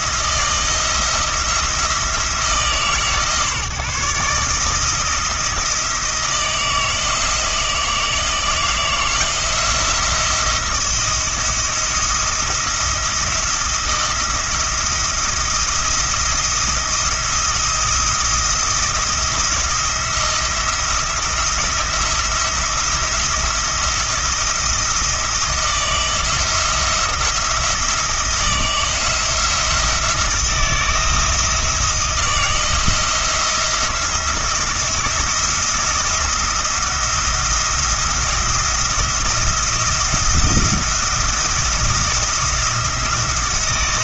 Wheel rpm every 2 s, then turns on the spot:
170, 150, 160, 160, 170, 170, 170, 170, 170, 170, 170, 170, 170, 170, 170, 170, 160, 170, 170, 170, 170, 170.
none